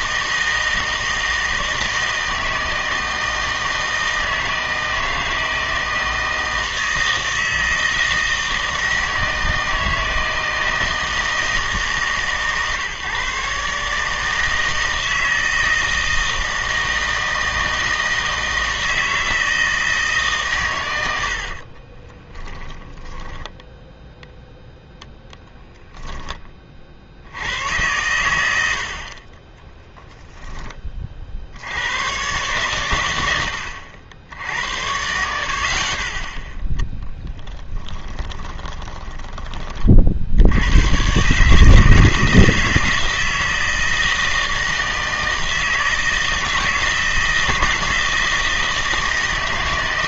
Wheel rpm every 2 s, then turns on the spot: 160, 160, 160, 160, 160, 160, 140, 160, 160, 160, 110, 10, 0, 40, 80, 20, 120, 80, 0, 20, 100, 160, 160, 160, 160.
22-24 38-40